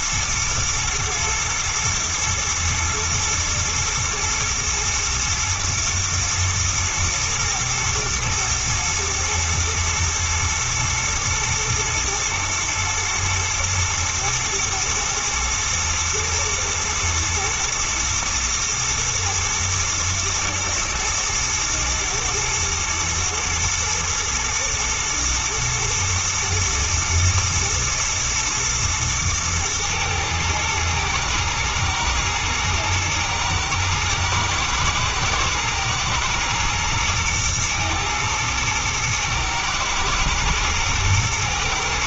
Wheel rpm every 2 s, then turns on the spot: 120, 120, 110, 110, 120, 110, 110, 110, 110, 110, 120, 110, 110, 110, 120, 110, 110, 120, 110, 110, 110.
none